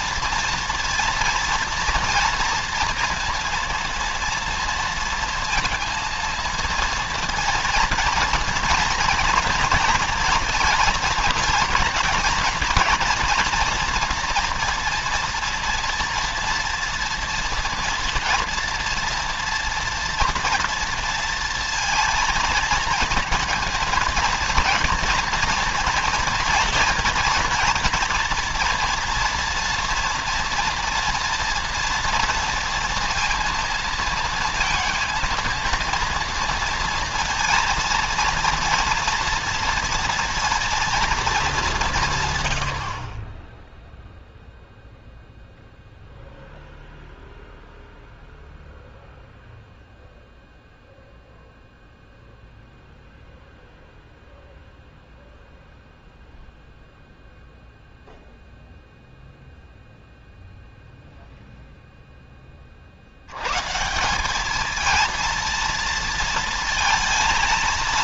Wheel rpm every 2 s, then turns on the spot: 230, 230, 230, 230, 230, 230, 240, 230, 230, 230, 240, 230, 230, 230, 230, 230, 230, 230, 230, 230, 230, 80, 0, 0, 0, 0, 0, 0, 0, 0, 0, 40, 220, 230.
none